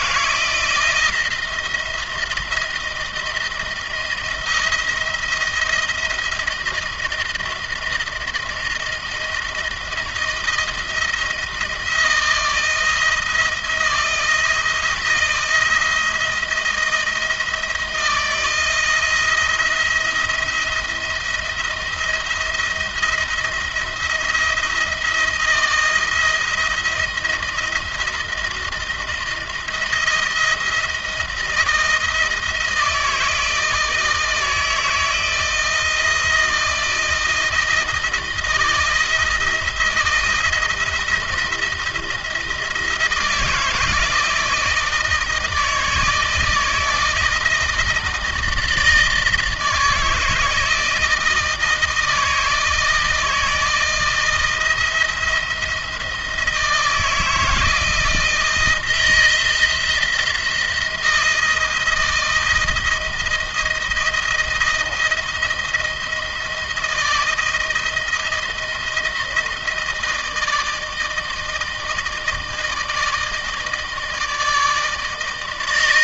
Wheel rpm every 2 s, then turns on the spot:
170, 170, 170, 170, 170, 170, 170, 170, 170, 170, 170, 170, 170, 170, 170, 170, 160, 160, 170, 170, 170, 170, 160, 160, 160, 160, 160, 160, 170, 160, 170, 160, 170, 170, 170, 160, 160, 160.
none